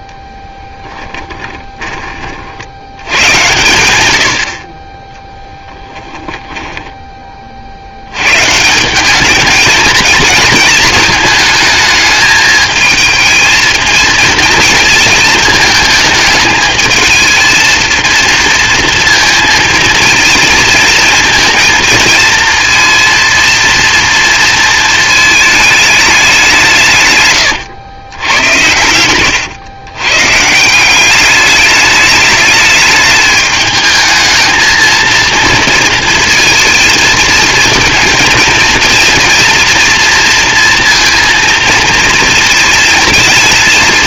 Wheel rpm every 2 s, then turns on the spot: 10, 70, 60, 10, 170, 220, 220, 220, 220, 230, 230, 230, 230, 170, 100, 180, 210, 220, 230, 230, 230, 230.
0-2 6-8 28-30